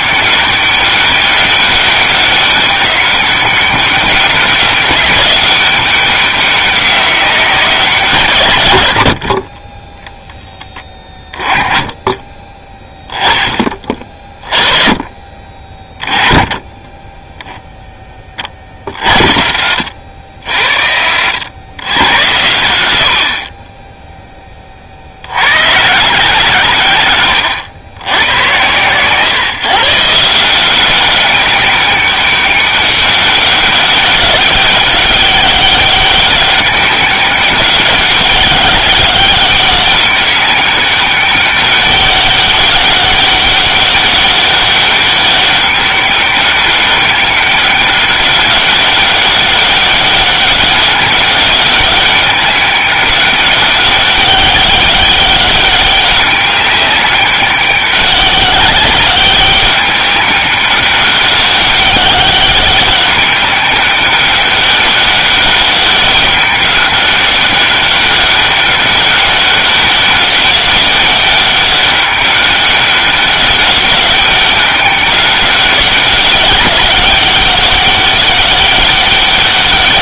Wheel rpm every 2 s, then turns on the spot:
200, 190, 190, 190, 80, 10, 10, 20, 20, 40, 50, 100, 20, 130, 120, 180, 200, 200, 200, 200, 200, 200, 200, 200, 200, 200, 200, 200, 200, 200, 200, 200, 200, 200, 200, 200, 200, 200, 190, 200.
20-22